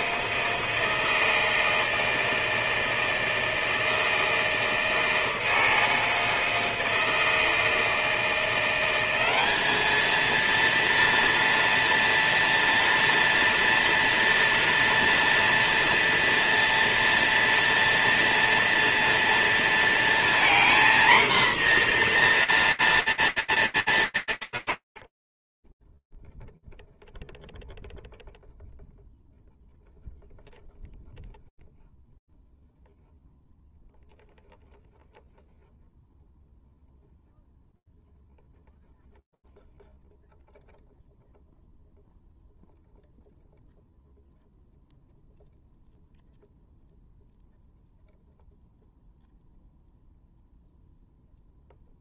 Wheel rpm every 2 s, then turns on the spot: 160, 160, 160, 160, 190, 230, 230, 230, 230, 230, 240, 240, 60, 0, 0, 0, 0, 0, 0, 0, 0, 0, 0, 0, 0, 0.
none